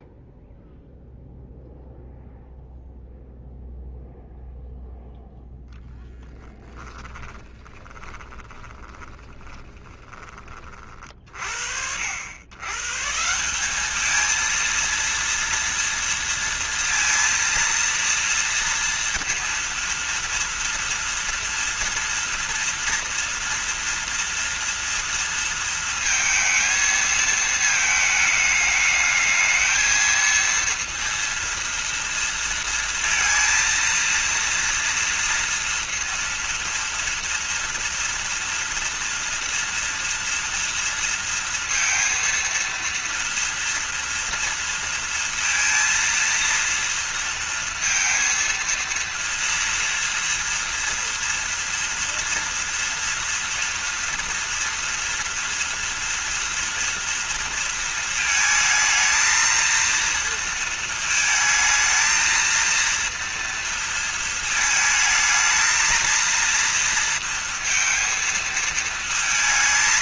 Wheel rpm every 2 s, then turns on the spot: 0, 0, 0, 10, 20, 40, 130, 230, 230, 230, 240, 240, 230, 220, 210, 230, 230, 230, 230, 230, 230, 230, 230, 230, 230, 240, 240, 240, 230, 220, 230, 230, 220, 230, 230.
6-10